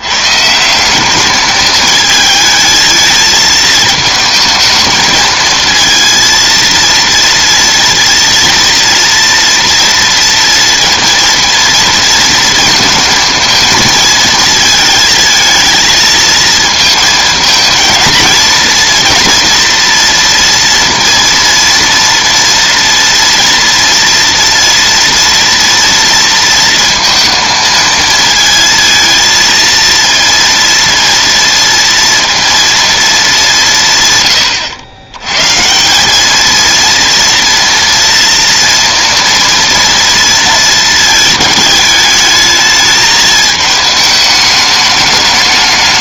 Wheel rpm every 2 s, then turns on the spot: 170, 220, 220, 230, 230, 230, 230, 230, 220, 230, 230, 230, 230, 230, 230, 230, 230, 100, 220, 230, 220, 210, 210.
none